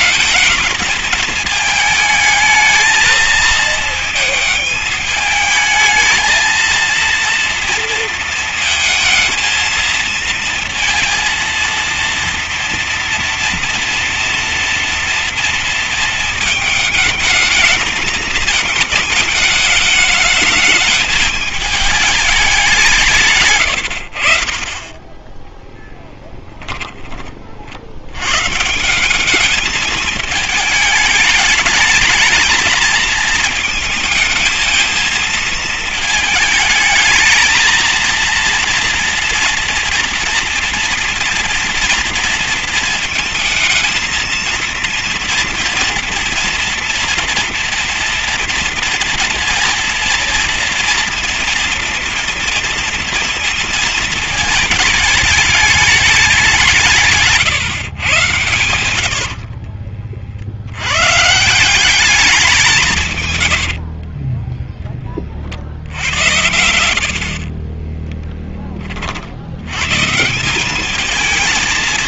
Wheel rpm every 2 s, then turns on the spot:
220, 220, 220, 230, 220, 230, 240, 240, 220, 220, 210, 180, 40, 10, 130, 220, 220, 220, 220, 230, 230, 230, 220, 230, 230, 230, 230, 220, 180, 100, 70, 180, 20, 80, 20, 190.
26-28 58-60 64-66